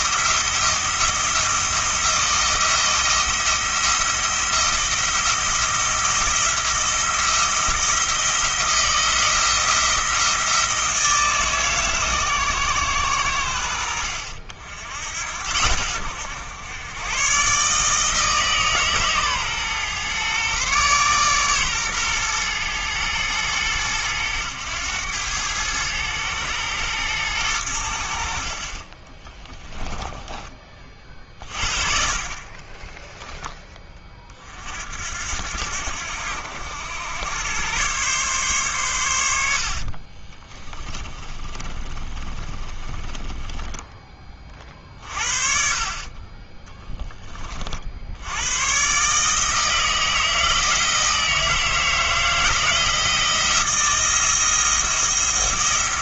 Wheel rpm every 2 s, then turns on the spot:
170, 170, 170, 170, 170, 160, 120, 70, 110, 140, 130, 110, 100, 110, 30, 30, 10, 60, 90, 110, 20, 30, 40, 10, 130, 160, 160, 170.
32-34 40-44